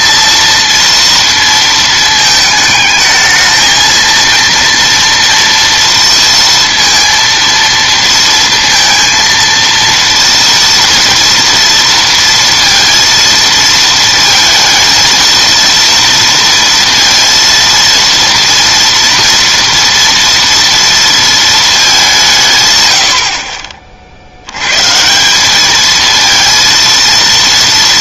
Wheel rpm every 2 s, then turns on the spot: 230, 220, 230, 230, 230, 240, 230, 230, 230, 230, 230, 130, 110, 230.
none